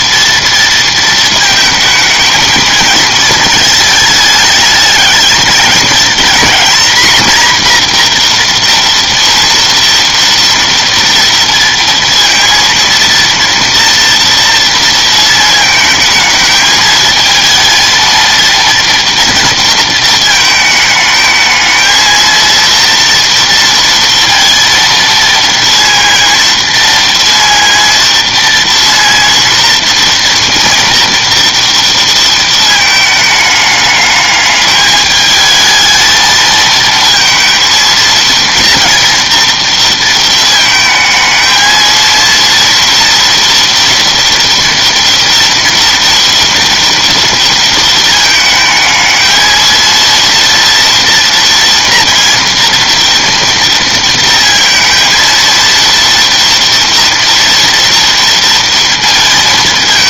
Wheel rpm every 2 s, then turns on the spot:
230, 220, 210, 230, 240, 230, 230, 230, 220, 230, 220, 230, 230, 230, 230, 240, 220, 210, 220, 230, 220, 230, 230, 230, 220, 230, 230, 230, 230, 230.
none